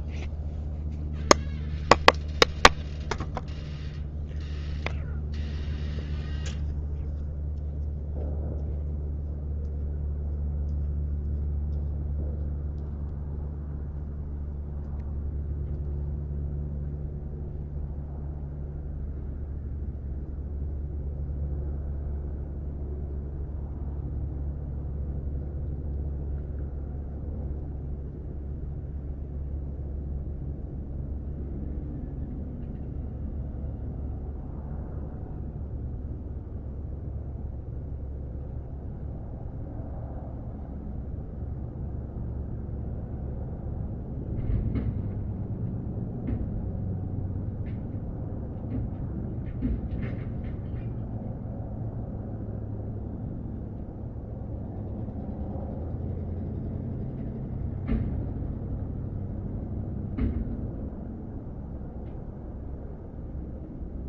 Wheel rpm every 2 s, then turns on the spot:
0, 0, 0, 0, 0, 0, 0, 0, 0, 0, 0, 0, 0, 0, 0, 0, 0, 0, 0, 0, 0, 0, 0, 0, 0, 0, 0, 0, 0, 0, 0, 0.
none